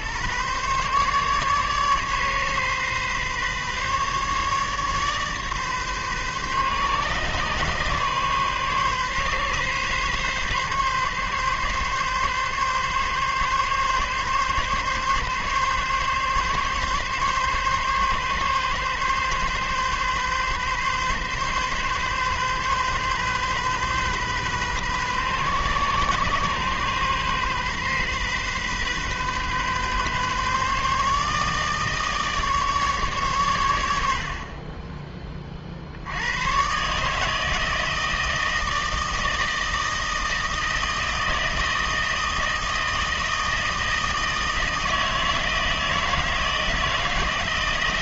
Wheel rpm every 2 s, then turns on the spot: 120, 140, 150, 140, 140, 130, 140, 140, 140, 140, 130, 130, 130, 130, 130, 140, 150, 40, 130, 160, 160, 160, 160, 160.
none